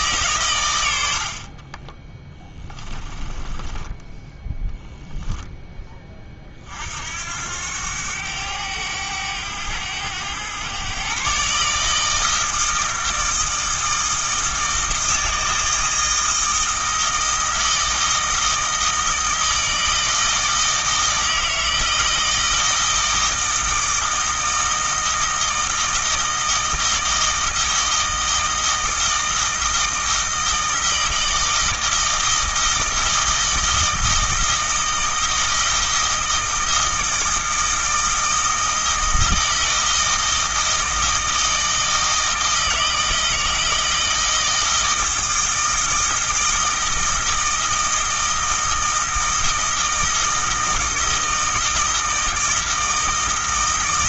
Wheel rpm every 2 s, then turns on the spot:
90, 20, 10, 60, 100, 120, 160, 160, 160, 160, 160, 160, 160, 160, 160, 160, 160, 160, 160, 160, 160, 160, 160, 160, 160, 160, 160.
2-4